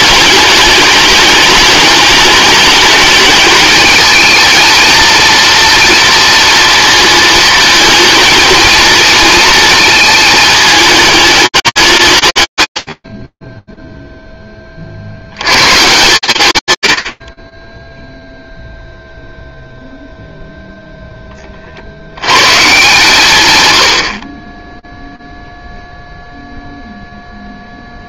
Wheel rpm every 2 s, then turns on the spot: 210, 210, 220, 230, 230, 210, 70, 10, 130, 0, 10, 140, 0, 0.
none